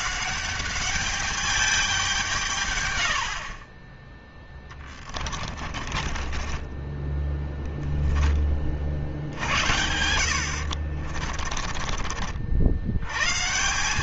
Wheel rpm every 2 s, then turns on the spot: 200, 110, 20, 20, 60, 50, 100.
4-8 10-12